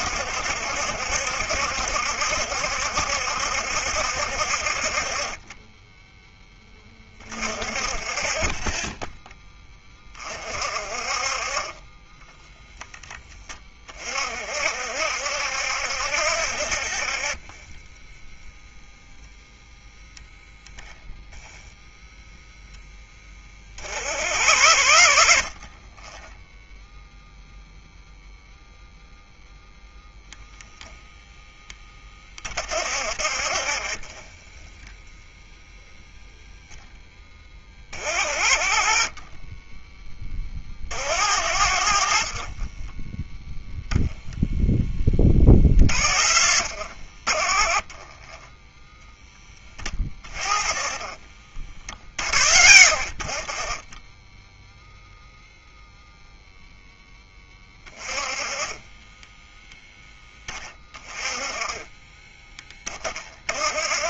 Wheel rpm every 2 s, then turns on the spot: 70, 70, 40, 20, 10, 40, 10, 60, 30, 0, 0, 10, 80, 0, 0, 0, 20, 10, 0, 40, 40, 30, 10, 60, 10, 20, 50, 0, 0, 20, 10, 10.
42-44 46-48 50-52 58-60